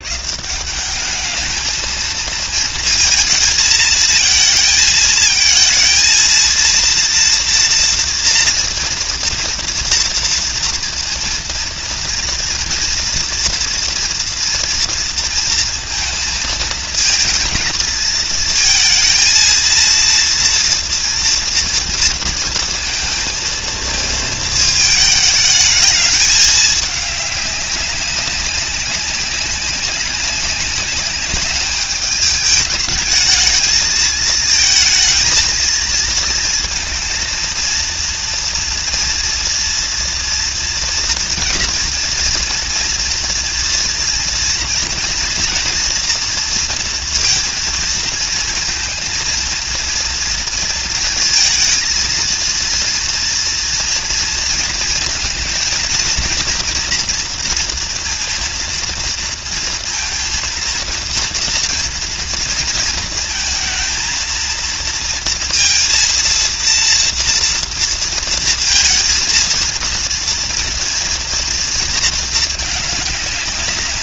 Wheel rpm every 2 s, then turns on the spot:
150, 220, 220, 230, 230, 230, 230, 230, 220, 220, 230, 230, 220, 210, 200, 200, 210, 230, 230, 230, 230, 240, 230, 230, 230, 230, 230, 230, 230, 230, 230, 230, 230, 230, 230, 230, 220.
none